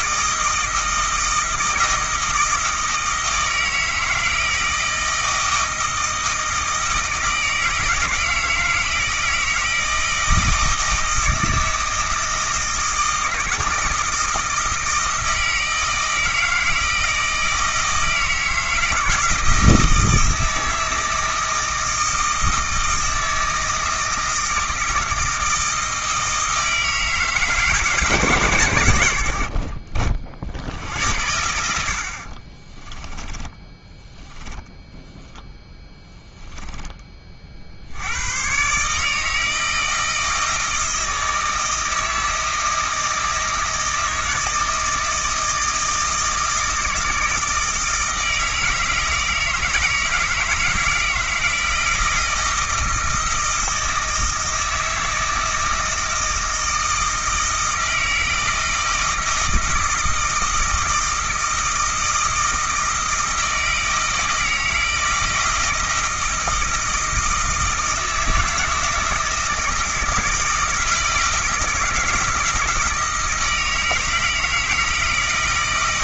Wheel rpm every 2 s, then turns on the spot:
160, 160, 160, 160, 160, 160, 160, 160, 160, 160, 160, 160, 160, 160, 130, 70, 30, 10, 10, 130, 160, 160, 160, 160, 160, 160, 160, 160, 160, 160, 160, 160, 160, 160, 160, 160, 160, 160.
32-34 36-38